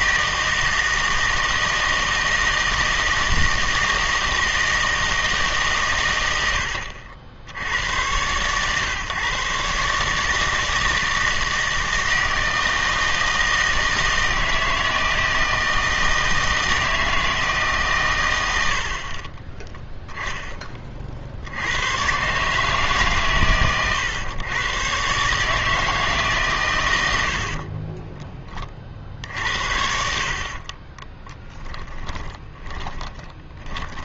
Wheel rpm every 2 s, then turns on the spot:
160, 160, 160, 90, 130, 160, 160, 160, 160, 90, 20, 150, 120, 130, 30, 40, 20.
30-34